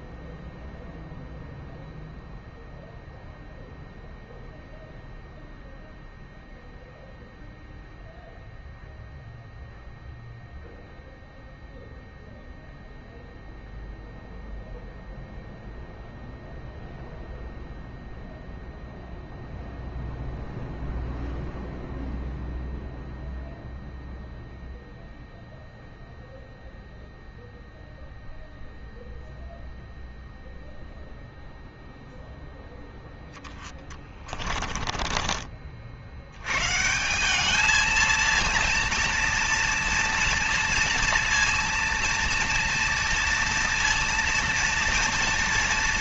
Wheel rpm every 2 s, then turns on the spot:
0, 0, 0, 0, 0, 0, 0, 0, 0, 0, 0, 0, 0, 0, 0, 0, 0, 30, 110, 230, 230, 230, 230.
34-36